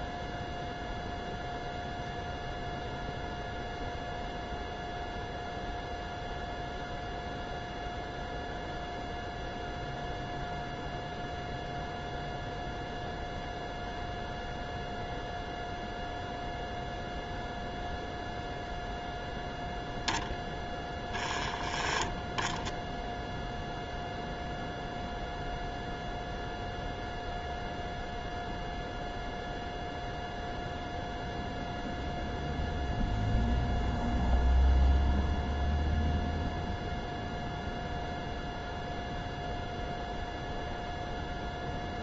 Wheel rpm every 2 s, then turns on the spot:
0, 0, 0, 0, 0, 0, 0, 0, 0, 0, 10, 10, 0, 0, 0, 0, 0, 0, 0, 0, 0.
none